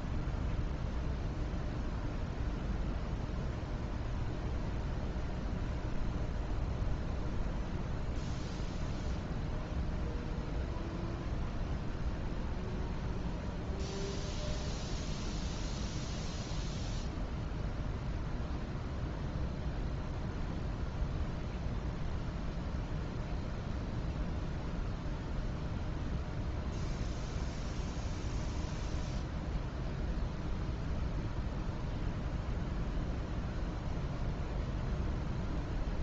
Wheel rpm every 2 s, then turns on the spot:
0, 0, 0, 0, 0, 0, 0, 0, 0, 0, 0, 0, 0, 0, 0, 0, 0, 0.
none